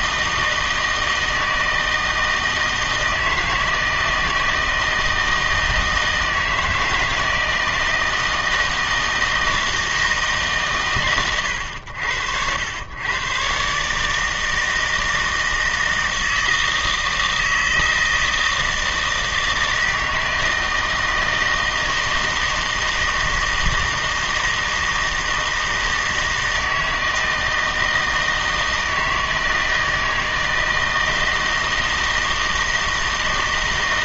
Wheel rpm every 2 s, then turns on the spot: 160, 160, 160, 160, 160, 140, 90, 160, 160, 160, 160, 160, 160, 160, 160, 160, 160.
none